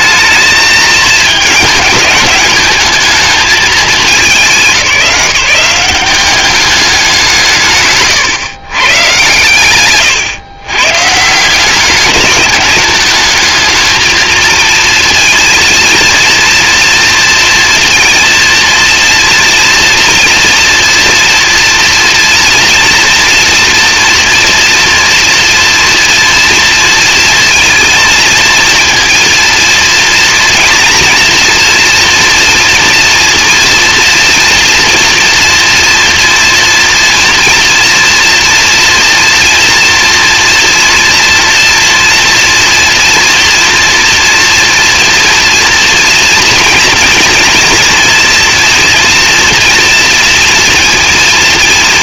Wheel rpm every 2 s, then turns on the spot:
220, 220, 180, 190, 120, 120, 210, 230, 230, 230, 230, 230, 240, 230, 230, 230, 230, 230, 230, 230, 230, 230, 230, 230, 230, 230.
none